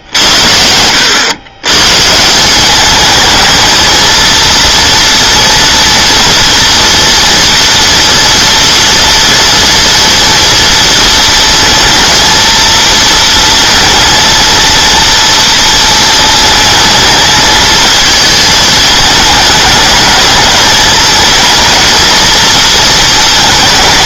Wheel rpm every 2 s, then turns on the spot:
90, 190, 230, 230, 230, 230, 230, 230, 220, 220, 220, 230.
none